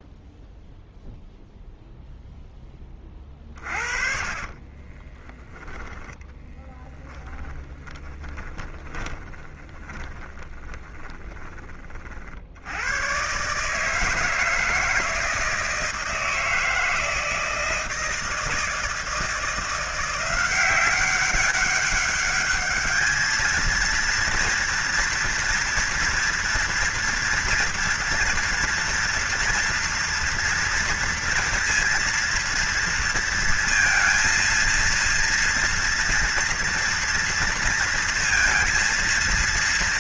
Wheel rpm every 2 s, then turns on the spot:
0, 10, 30, 10, 10, 20, 80, 160, 160, 160, 180, 210, 230, 230, 240, 240, 230, 230, 230, 230.
4-12